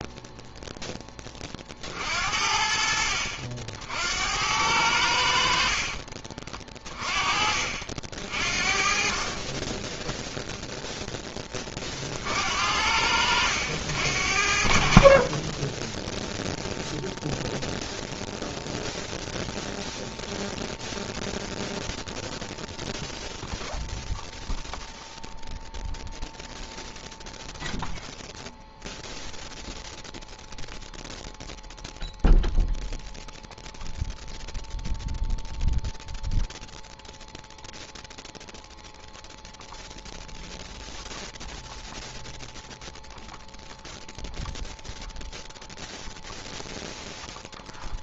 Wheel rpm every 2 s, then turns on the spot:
10, 60, 80, 30, 40, 0, 70, 50, 0, 0, 0, 0, 0, 0, 0, 0, 0, 0, 0, 0, 0, 0, 0, 0.
6-8